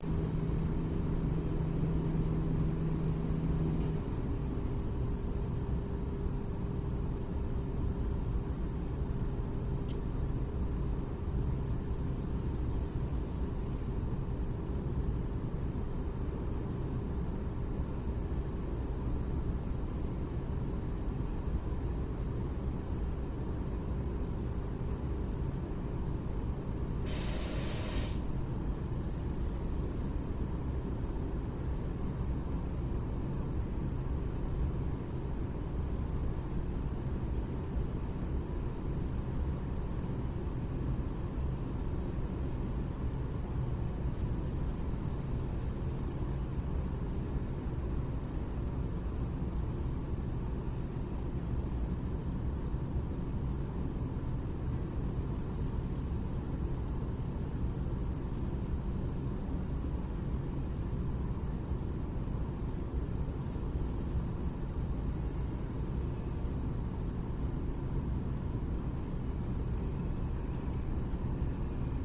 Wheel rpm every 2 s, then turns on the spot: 0, 0, 0, 0, 0, 0, 0, 0, 0, 0, 0, 0, 0, 0, 0, 0, 0, 0, 0, 0, 0, 0, 0, 0, 0, 0, 0, 0, 0, 0, 0, 0, 0, 0, 0, 0.
none